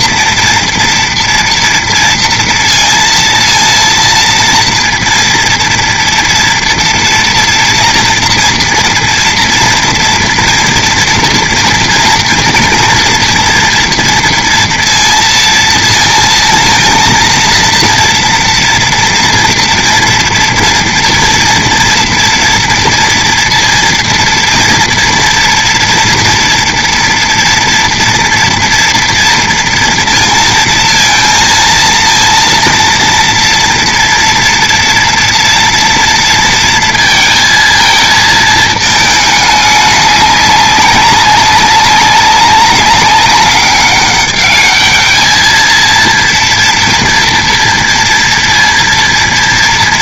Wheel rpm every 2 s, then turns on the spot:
230, 230, 230, 240, 240, 230, 240, 230, 230, 230, 230, 230, 230, 230, 230, 230, 230, 230, 230, 220, 200, 200, 210, 230, 230.
none